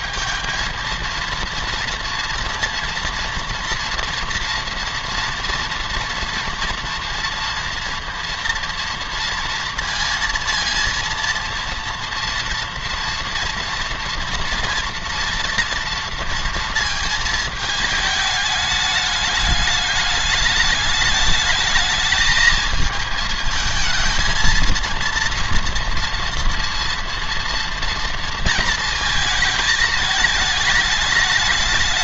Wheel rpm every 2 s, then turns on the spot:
230, 230, 230, 230, 240, 230, 230, 240, 230, 210, 210, 220, 230, 230, 230, 210.
none